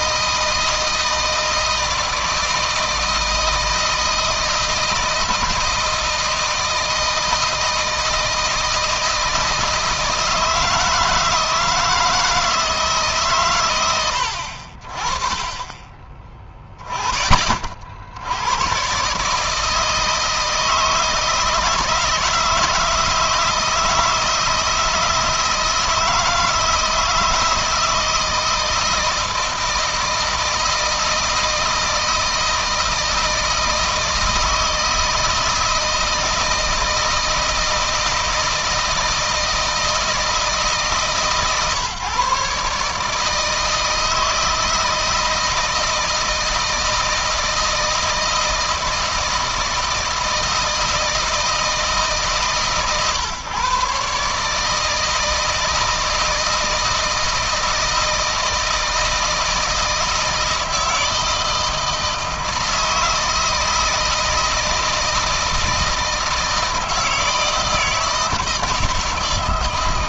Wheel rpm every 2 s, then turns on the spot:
160, 160, 160, 160, 160, 160, 140, 40, 20, 130, 160, 160, 160, 160, 160, 160, 160, 160, 160, 160, 160, 150, 160, 170, 160, 160, 140, 160, 160, 160, 160, 160, 160, 160, 160.
none